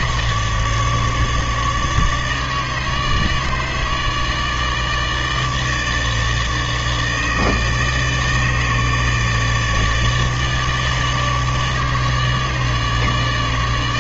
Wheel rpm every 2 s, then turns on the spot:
150, 150, 160, 150, 150, 150, 150.
none